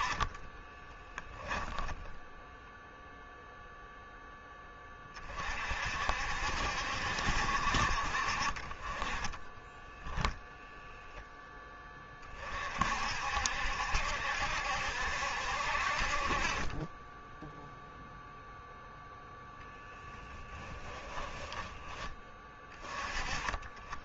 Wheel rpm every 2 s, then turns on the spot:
20, 0, 20, 60, 30, 0, 60, 70, 20, 0, 10, 20.
0-2 8-10 20-22